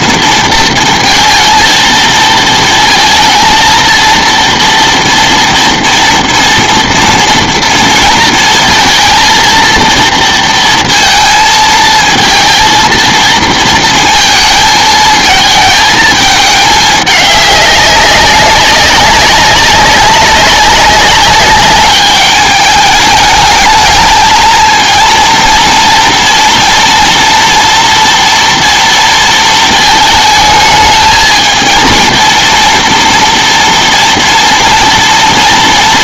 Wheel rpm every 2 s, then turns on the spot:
230, 230, 230, 230, 230, 230, 230, 230, 210, 200, 200, 210, 230, 230, 230, 220, 230, 230.
none